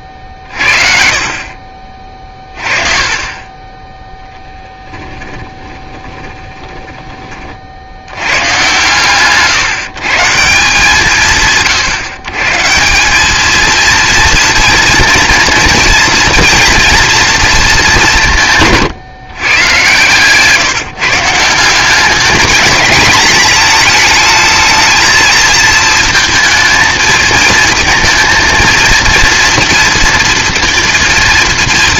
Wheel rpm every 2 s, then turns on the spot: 20, 20, 10, 10, 130, 160, 150, 230, 240, 150, 150, 210, 220, 230, 230, 230.
4-8